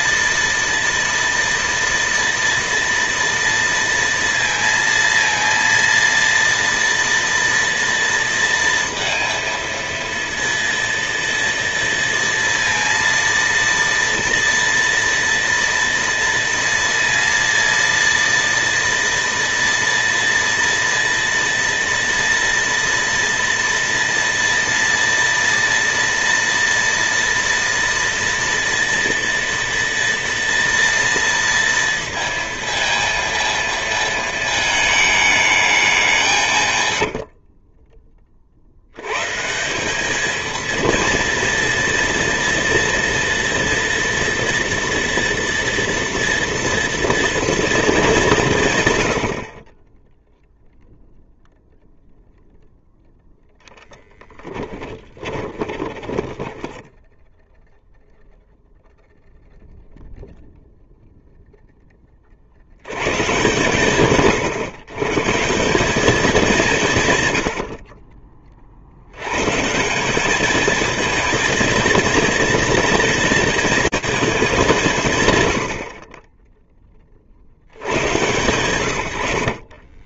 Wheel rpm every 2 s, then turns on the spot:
230, 230, 230, 240, 230, 230, 230, 230, 230, 230, 230, 230, 230, 230, 230, 230, 230, 220, 100, 110, 230, 230, 230, 230, 100, 0, 0, 20, 10, 0, 0, 110, 150, 140, 90, 220, 230, 160, 40, 90.
36-38 54-58